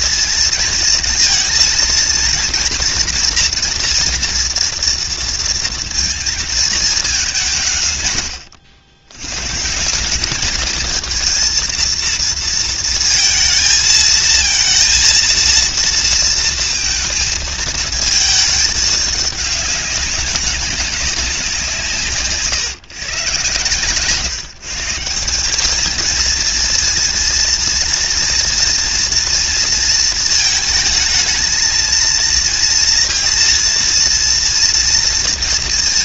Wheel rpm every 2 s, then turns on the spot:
230, 230, 230, 210, 90, 220, 230, 230, 220, 210, 200, 130, 170, 230, 230, 220, 230, 230.
none